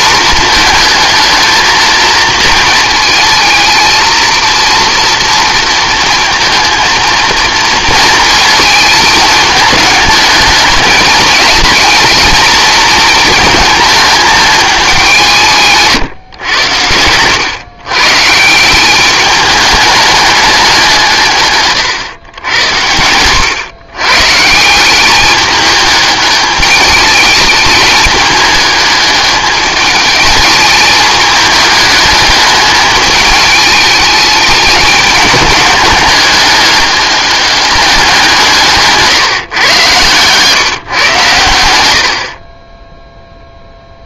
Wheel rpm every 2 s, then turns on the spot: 220, 220, 230, 230, 220, 210, 220, 200, 100, 170, 200, 90, 170, 210, 210, 210, 210, 210, 210, 170, 140, 30.
none